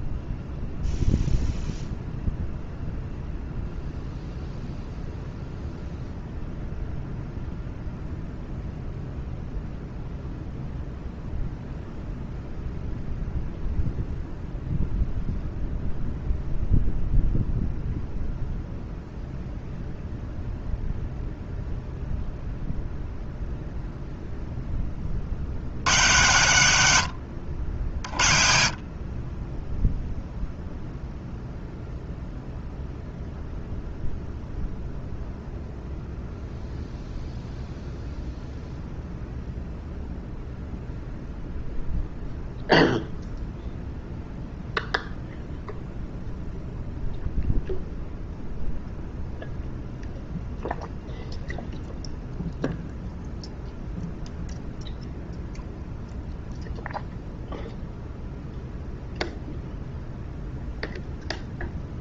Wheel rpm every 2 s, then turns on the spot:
0, 0, 0, 0, 0, 0, 0, 0, 0, 0, 0, 0, 20, 100, 40, 0, 0, 0, 0, 0, 0, 0, 0, 0, 0, 0, 0, 0, 0, 0, 0.
none